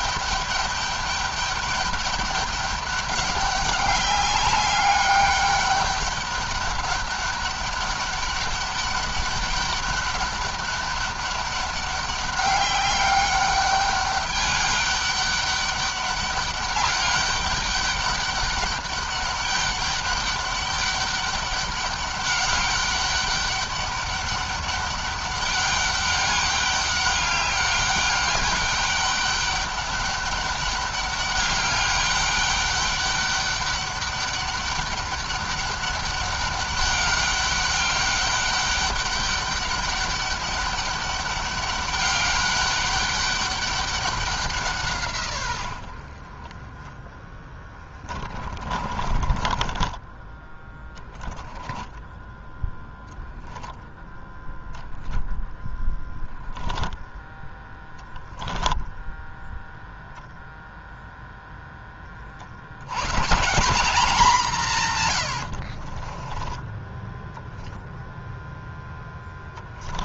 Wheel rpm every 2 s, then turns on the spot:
200, 200, 200, 200, 200, 200, 200, 200, 200, 200, 200, 200, 200, 200, 200, 200, 200, 200, 200, 200, 200, 200, 170, 20, 30, 10, 0, 10, 10, 10, 0, 80, 160, 10, 0.
48-50 58-60 66-68